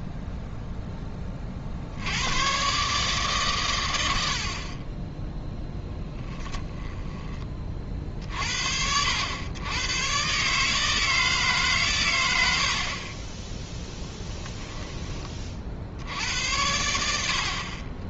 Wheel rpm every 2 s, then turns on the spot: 10, 140, 20, 10, 70, 160, 40, 20, 90.
6-8